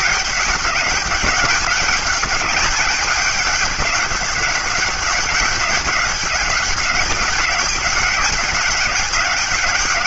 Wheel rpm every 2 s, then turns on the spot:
200, 210, 200, 200, 200.
none